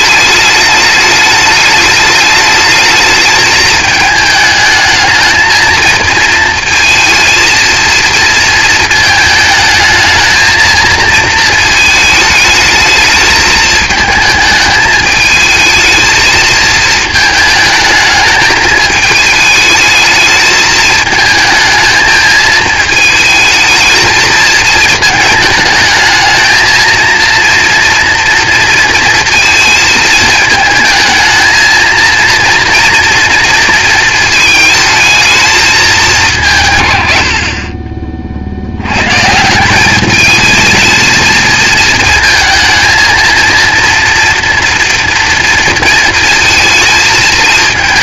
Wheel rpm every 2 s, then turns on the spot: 210, 210, 220, 230, 220, 230, 220, 210, 220, 220, 210, 220, 220, 230, 230, 220, 230, 220, 150, 80, 220, 230, 230, 220.
none